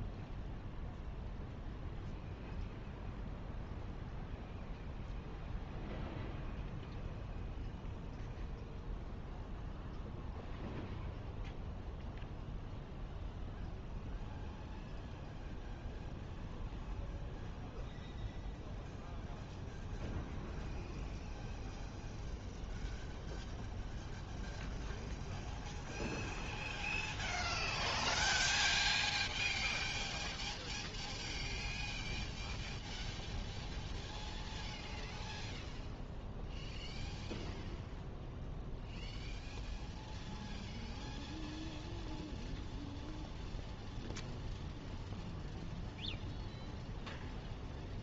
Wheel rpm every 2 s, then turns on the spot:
0, 0, 0, 0, 0, 0, 0, 0, 0, 0, 0, 0, 0, 0, 0, 0, 0, 0, 0, 0, 0, 0, 0, 0.
none